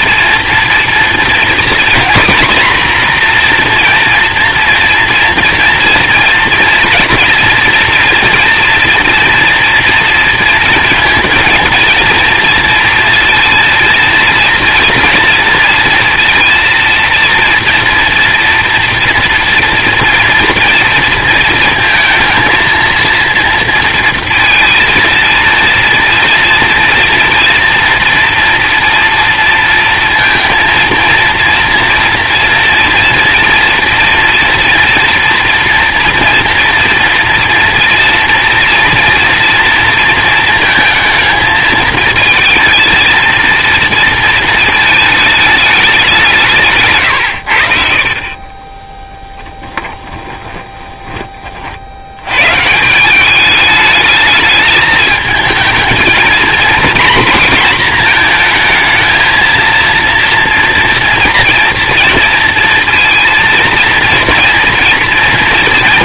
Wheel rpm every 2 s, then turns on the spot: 230, 240, 240, 240, 230, 230, 230, 230, 230, 230, 240, 220, 230, 230, 230, 230, 230, 240, 230, 230, 230, 220, 230, 150, 20, 20, 140, 210, 240, 230, 230, 230, 230.
48-52